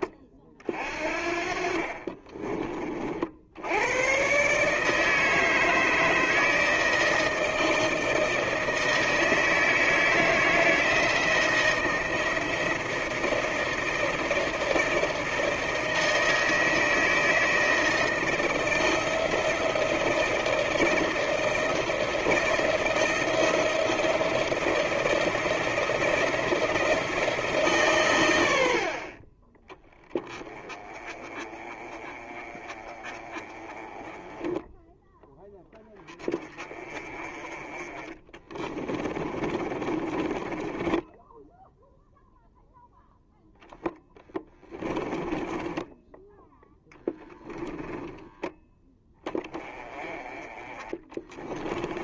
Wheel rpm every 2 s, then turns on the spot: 40, 30, 140, 160, 160, 160, 160, 160, 160, 160, 160, 160, 160, 160, 80, 20, 30, 10, 20, 20, 20, 0, 10, 0, 10, 20.
38-42 44-46